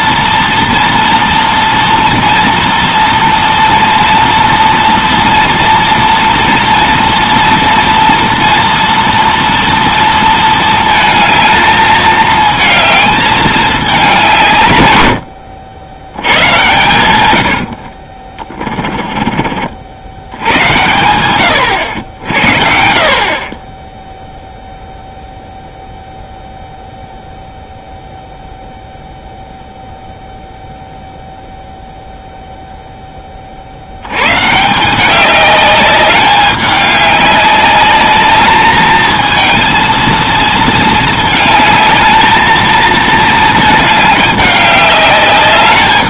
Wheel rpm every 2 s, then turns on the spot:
230, 230, 230, 230, 230, 220, 220, 140, 100, 20, 70, 50, 0, 0, 0, 0, 0, 170, 200, 210, 220, 220, 200.
18-20